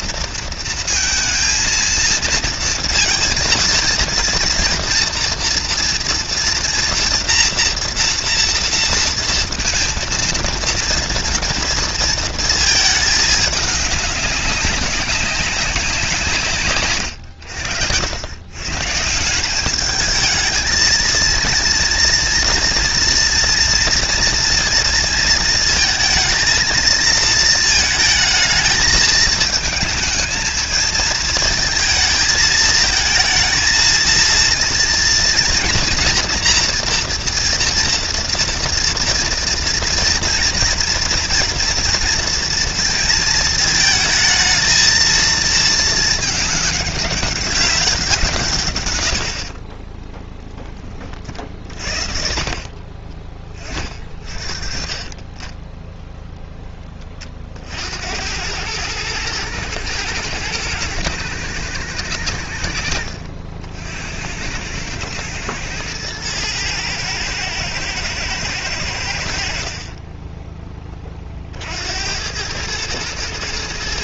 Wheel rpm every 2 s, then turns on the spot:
230, 230, 230, 230, 230, 230, 220, 200, 120, 150, 230, 230, 230, 230, 220, 220, 220, 230, 240, 240, 240, 230, 220, 200, 100, 30, 30, 30, 20, 110, 120, 70, 100, 110, 80, 30, 110.
none